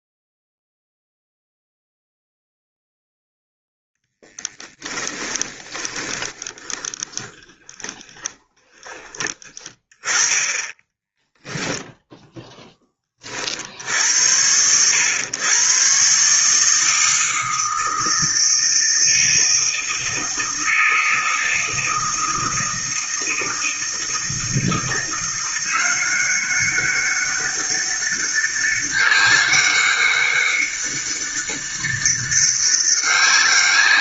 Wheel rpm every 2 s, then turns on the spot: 0, 0, 20, 10, 20, 10, 10, 100, 160, 160, 160, 160, 170, 200, 200, 200, 200.
4-8 10-12